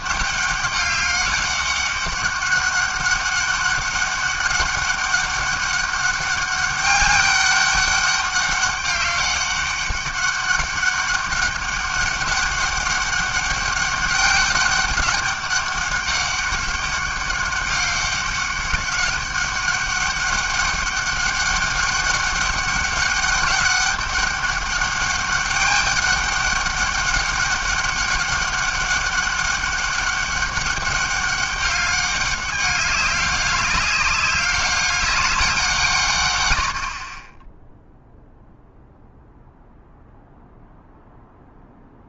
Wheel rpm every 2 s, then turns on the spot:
200, 200, 200, 200, 200, 200, 200, 200, 200, 200, 200, 200, 200, 200, 200, 200, 200, 200, 30, 0, 0.
none